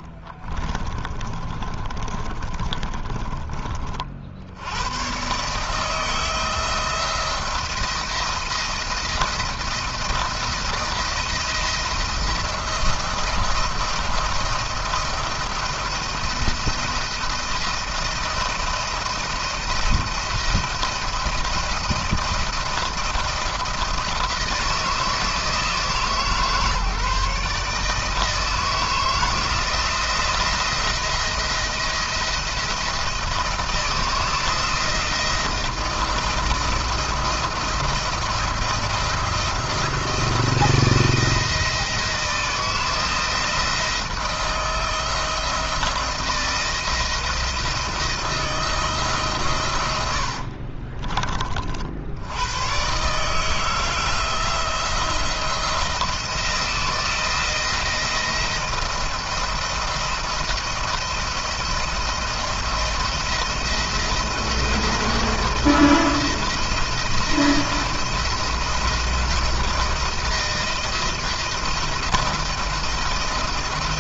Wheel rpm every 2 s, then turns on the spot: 40, 30, 80, 170, 170, 170, 170, 170, 170, 170, 170, 160, 170, 150, 160, 170, 170, 160, 160, 160, 170, 160, 160, 170, 160, 50, 100, 170, 170, 170, 170, 170, 170, 170, 170, 170, 170.
0-4 50-52